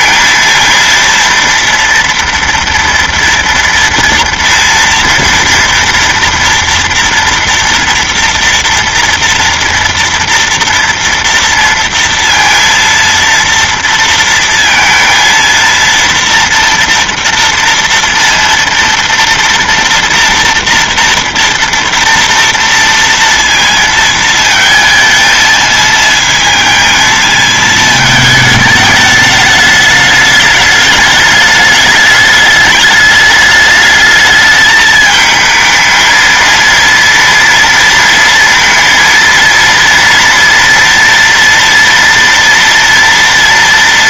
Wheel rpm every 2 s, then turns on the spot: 230, 230, 240, 230, 230, 230, 230, 230, 230, 230, 230, 230, 230, 230, 220, 210, 210, 210, 230, 230, 230, 230.
none